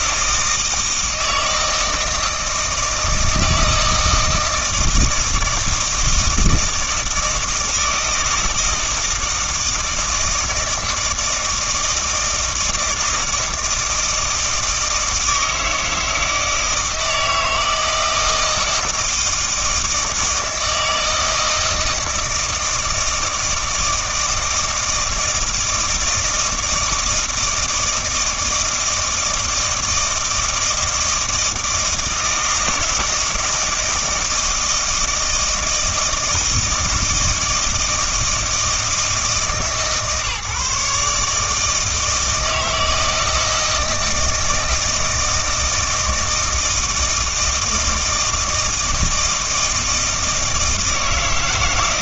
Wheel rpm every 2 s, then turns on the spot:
160, 160, 160, 160, 160, 160, 160, 160, 160, 170, 160, 160, 160, 160, 160, 160, 160, 160, 160, 160, 150, 160, 160, 160, 160, 160.
none